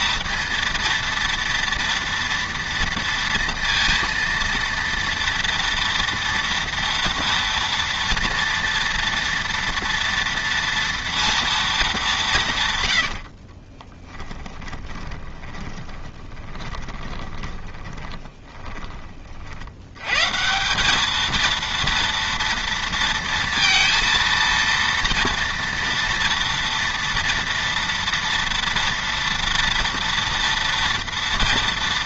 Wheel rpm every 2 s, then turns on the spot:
230, 230, 230, 230, 230, 230, 140, 10, 20, 20, 190, 230, 230, 230, 230, 230.
12-20